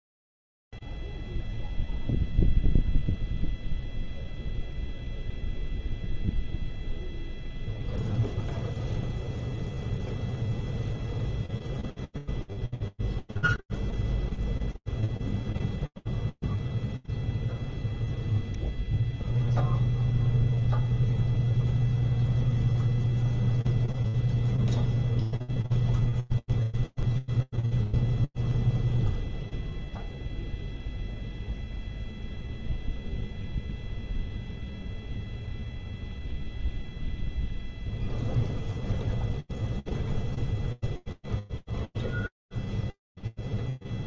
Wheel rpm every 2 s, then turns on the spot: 0, 0, 0, 0, 0, 0, 0, 0, 0, 0, 0, 0, 0, 0, 0, 0, 0, 0, 0, 0, 0, 0.
none